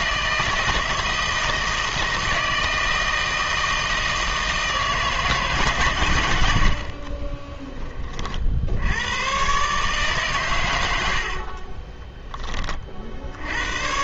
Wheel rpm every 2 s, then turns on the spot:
160, 160, 160, 70, 80, 100, 40.
none